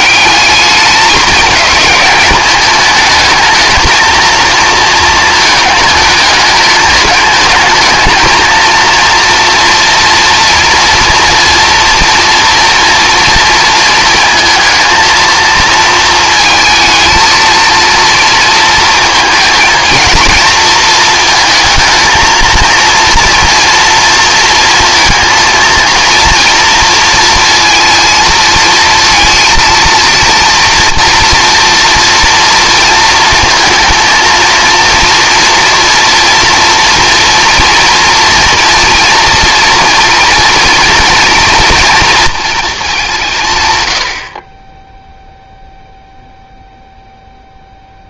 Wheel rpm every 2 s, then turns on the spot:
210, 210, 220, 210, 230, 230, 230, 230, 220, 220, 220, 230, 230, 230, 230, 230, 230, 230, 230, 230, 240, 200, 10, 0.
none